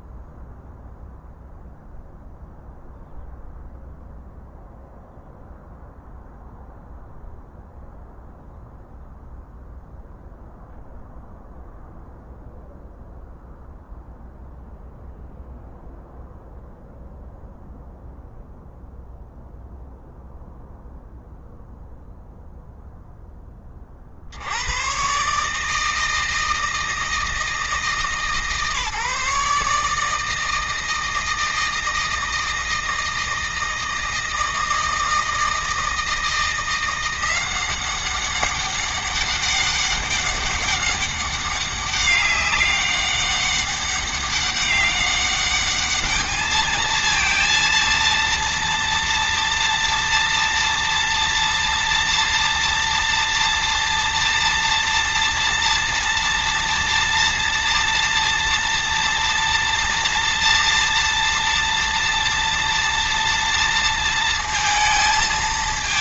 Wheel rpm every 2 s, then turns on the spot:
0, 0, 0, 0, 0, 0, 0, 0, 0, 0, 0, 0, 110, 160, 150, 160, 160, 160, 170, 200, 200, 200, 200, 220, 230, 230, 230, 230, 230, 230, 230, 240, 230.
none